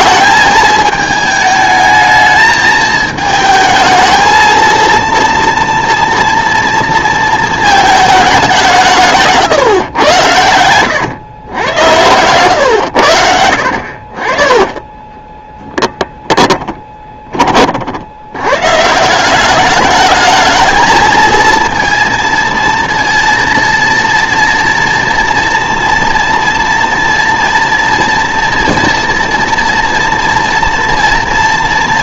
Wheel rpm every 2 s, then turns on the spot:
220, 220, 230, 230, 170, 100, 100, 20, 20, 150, 220, 230, 240, 230, 230, 240.
14-16